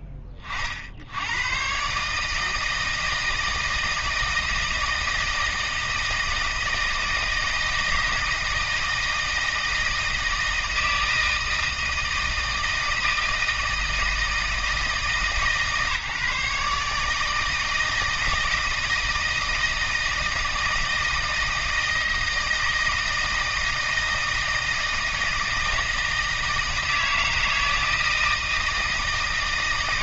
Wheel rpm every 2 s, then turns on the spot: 30, 160, 160, 160, 160, 160, 160, 160, 150, 160, 160, 160, 160, 160, 160.
none